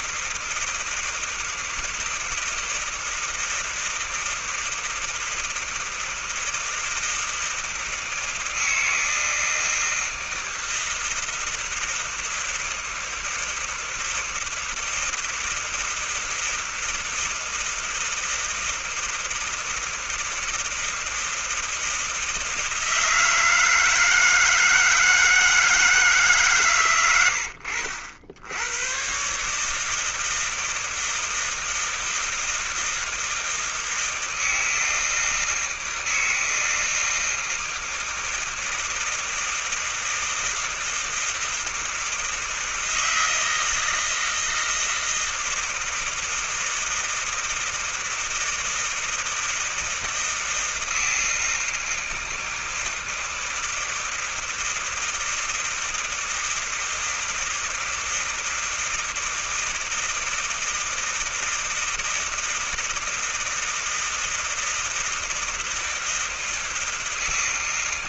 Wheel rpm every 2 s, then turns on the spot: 160, 160, 160, 160, 160, 160, 160, 160, 160, 160, 160, 160, 160, 150, 70, 160, 160, 160, 160, 160, 160, 160, 170, 160, 160, 160, 160, 160, 160, 160, 160, 160, 160, 160.
none